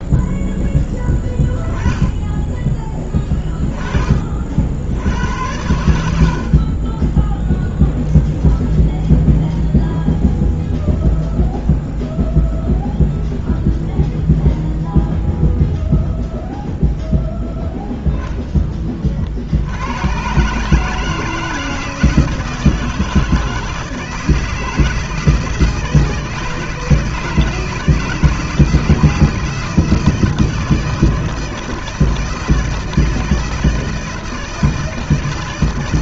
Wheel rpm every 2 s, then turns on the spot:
10, 20, 70, 20, 0, 0, 0, 0, 0, 30, 150, 160, 160, 160, 160, 160, 160, 160.
none